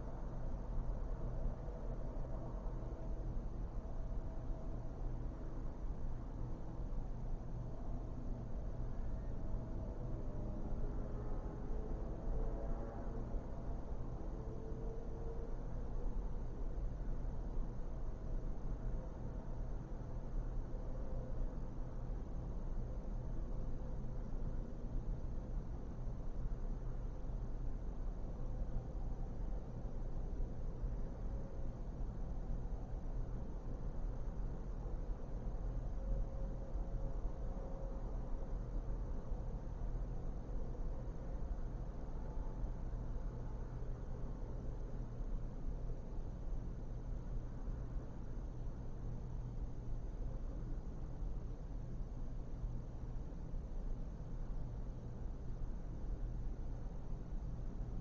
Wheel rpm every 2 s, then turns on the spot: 0, 0, 0, 0, 0, 0, 0, 0, 0, 0, 0, 0, 0, 0, 0, 0, 0, 0, 0, 0, 0, 0, 0, 0, 0, 0, 0, 0, 0.
none